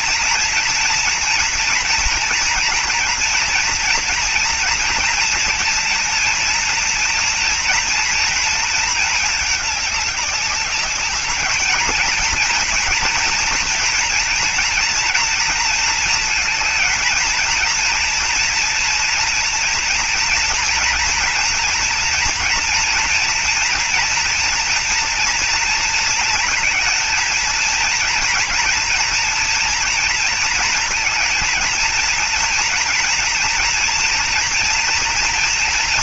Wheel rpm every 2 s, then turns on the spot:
230, 240, 230, 230, 230, 210, 220, 230, 230, 230, 230, 230, 230, 230, 230, 230, 230, 230.
none